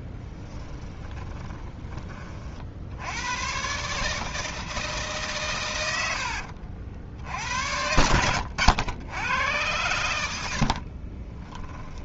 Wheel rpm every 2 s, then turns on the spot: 10, 60, 160, 70, 90, 60.
0-2